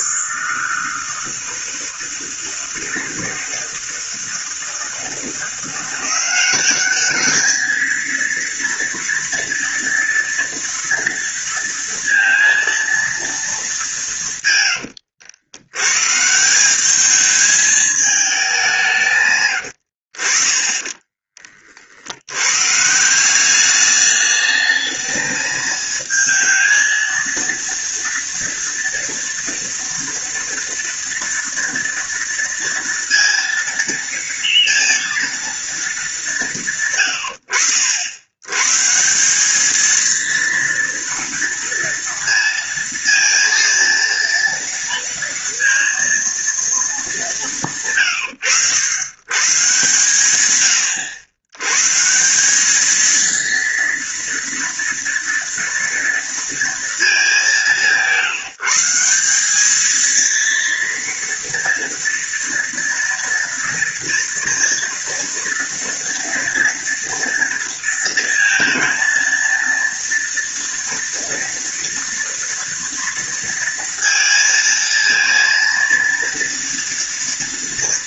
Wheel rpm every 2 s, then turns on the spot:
160, 160, 160, 200, 230, 230, 230, 110, 200, 170, 30, 140, 210, 220, 230, 230, 230, 230, 140, 140, 230, 230, 230, 230, 100, 100, 210, 230, 220, 180, 230, 230, 230, 230, 230, 230, 230, 230, 230.
14-16